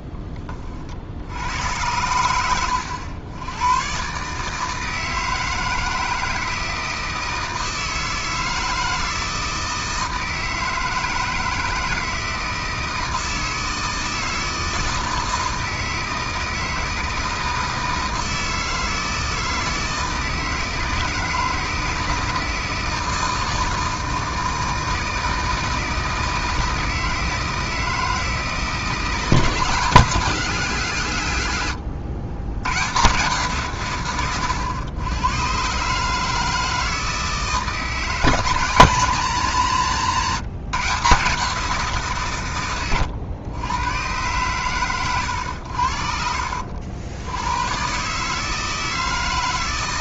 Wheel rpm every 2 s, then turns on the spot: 30, 90, 160, 160, 160, 160, 160, 160, 160, 160, 160, 160, 160, 160, 160, 170, 120, 100, 160, 170, 160, 110, 130, 70, 160.
none